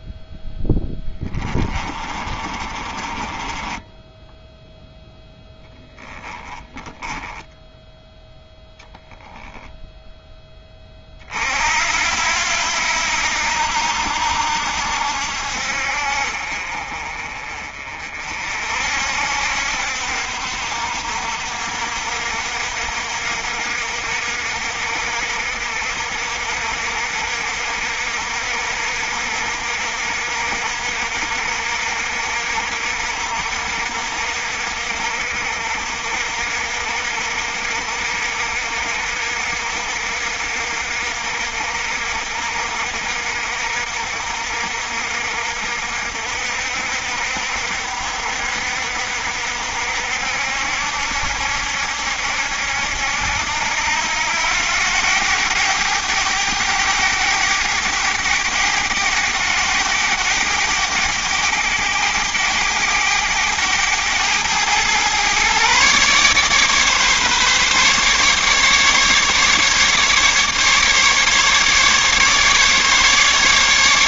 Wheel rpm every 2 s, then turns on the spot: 10, 30, 0, 20, 0, 30, 80, 70, 40, 60, 60, 60, 60, 60, 60, 60, 60, 60, 60, 60, 60, 60, 60, 60, 60, 70, 80, 90, 100, 100, 100, 100, 110, 140, 140, 150, 150.
0-4 6-8